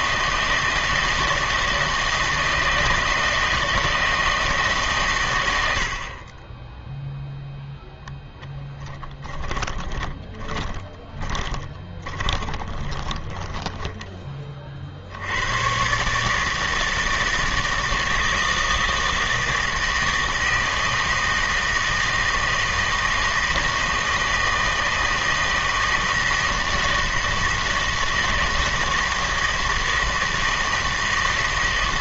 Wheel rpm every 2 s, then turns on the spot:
160, 160, 160, 20, 10, 20, 30, 30, 160, 160, 160, 160, 160, 160, 160, 160.
8-14